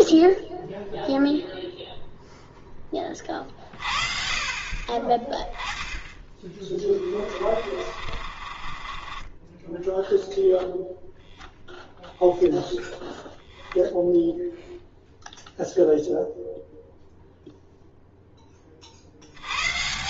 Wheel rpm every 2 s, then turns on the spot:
0, 10, 40, 20, 30, 0, 0, 0, 0, 50.
6-10